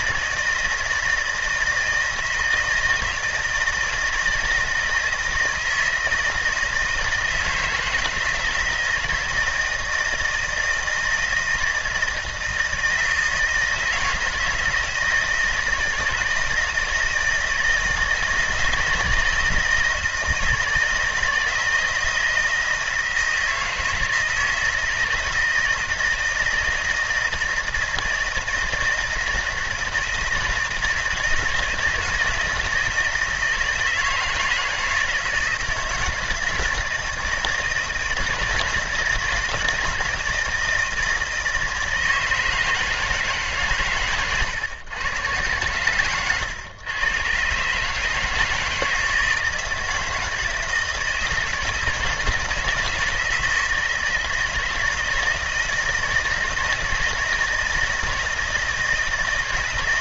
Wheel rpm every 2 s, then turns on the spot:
160, 160, 160, 160, 160, 160, 160, 160, 160, 160, 160, 170, 160, 160, 160, 160, 160, 160, 170, 160, 160, 160, 110, 130, 160, 160, 160, 160, 160, 160.
none